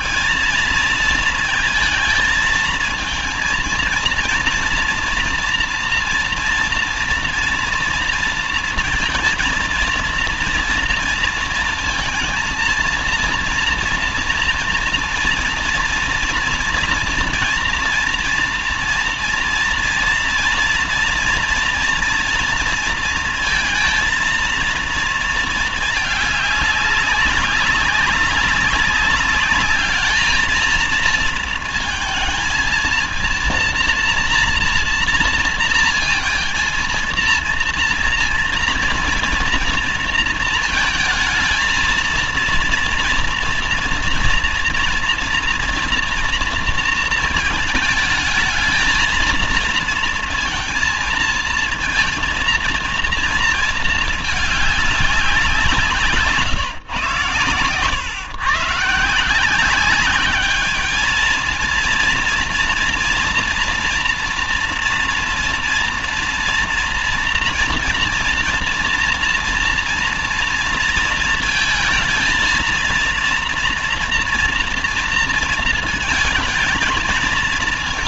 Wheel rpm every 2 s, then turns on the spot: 220, 220, 230, 240, 230, 230, 230, 230, 230, 230, 230, 230, 230, 200, 200, 230, 230, 230, 230, 230, 220, 230, 230, 230, 220, 230, 230, 210, 140, 130, 210, 230, 230, 240, 240, 230, 230, 230, 220.
none